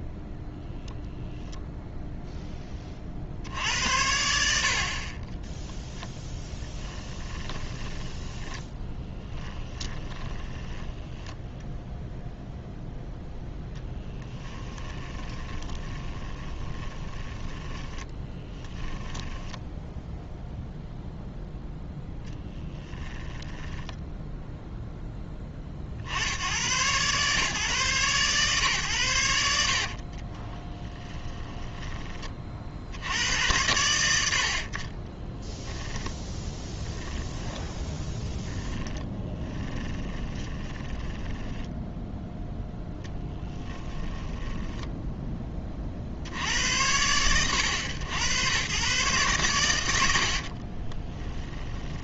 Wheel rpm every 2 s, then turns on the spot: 0, 20, 40, 10, 10, 10, 0, 20, 20, 10, 0, 10, 10, 110, 120, 20, 30, 50, 10, 10, 20, 0, 10, 60, 100, 40.
6-12 14-20 30-32 36-42 50-52